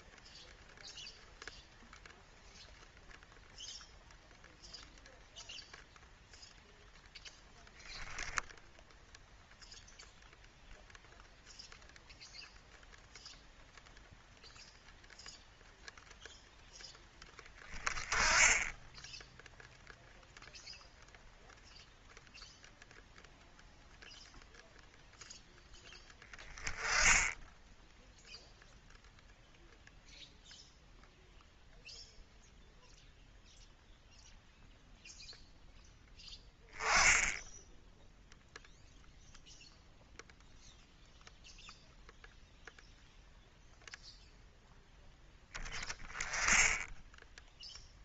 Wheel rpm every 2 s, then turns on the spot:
0, 0, 0, 0, 0, 0, 0, 0, 0, 10, 0, 0, 0, 10, 0, 0, 0, 0, 10, 0, 0, 0, 0, 10.
none